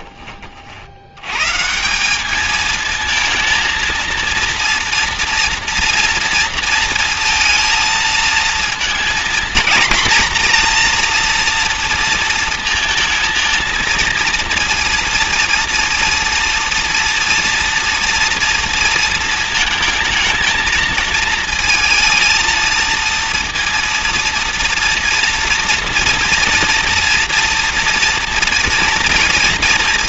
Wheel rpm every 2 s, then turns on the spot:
160, 230, 240, 230, 240, 230, 230, 230, 240, 220, 230, 230, 230, 230, 230.
none